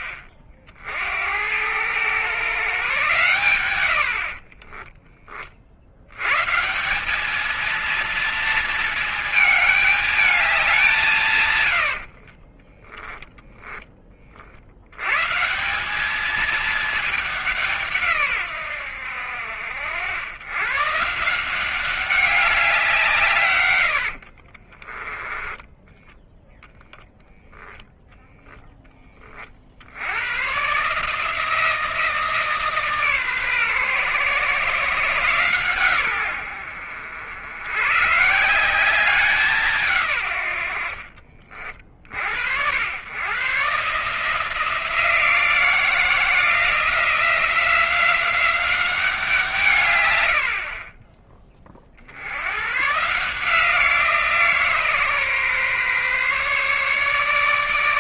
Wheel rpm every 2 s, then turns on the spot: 80, 120, 40, 110, 230, 200, 50, 60, 200, 120, 110, 190, 70, 10, 10, 110, 160, 130, 90, 150, 110, 70, 160, 170, 190, 90, 90, 160, 140.
4-6 12-14 24-26